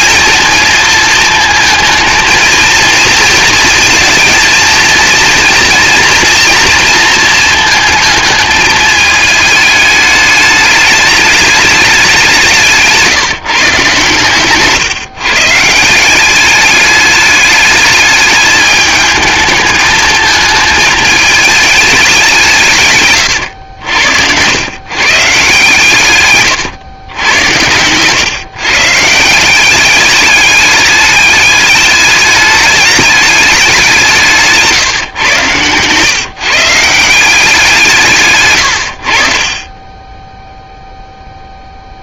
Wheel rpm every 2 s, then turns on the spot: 230, 220, 230, 230, 210, 210, 170, 140, 200, 210, 210, 160, 110, 120, 150, 210, 210, 150, 150, 110, 0.
38-40